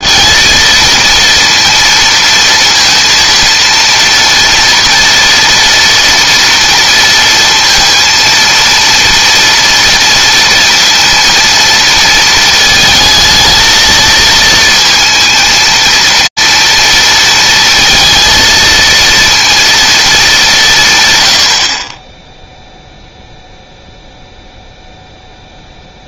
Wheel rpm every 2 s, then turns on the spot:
230, 230, 240, 230, 230, 230, 230, 230, 230, 230, 170, 0, 0.
none